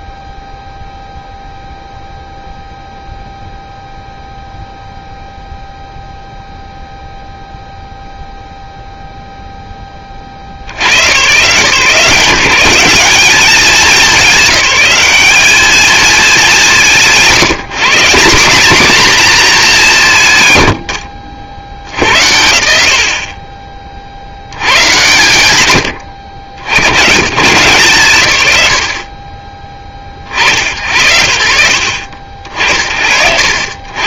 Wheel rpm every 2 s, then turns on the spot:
0, 0, 0, 0, 0, 90, 180, 200, 140, 230, 90, 70, 110, 90, 100, 70, 60.
none